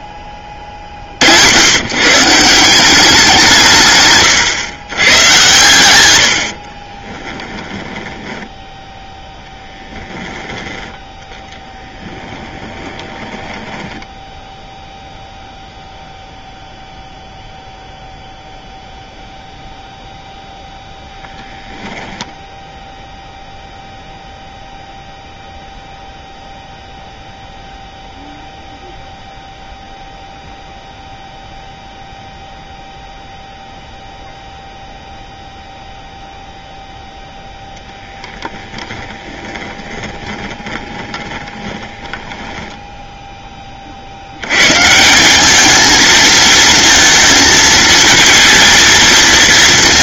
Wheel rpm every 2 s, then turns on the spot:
40, 180, 120, 50, 10, 10, 10, 0, 0, 0, 10, 0, 0, 0, 0, 0, 0, 0, 0, 10, 20, 10, 140, 230, 230.
6-10 12-14 38-42